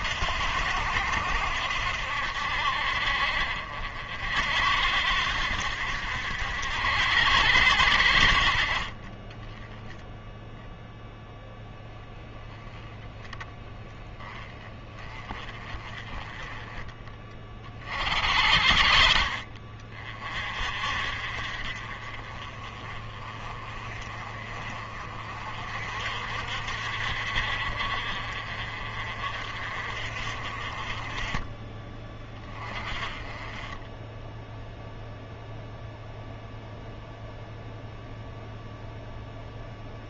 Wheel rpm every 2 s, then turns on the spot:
70, 60, 70, 70, 40, 0, 10, 20, 20, 60, 40, 30, 40, 50, 40, 30, 20, 0, 0, 0.
none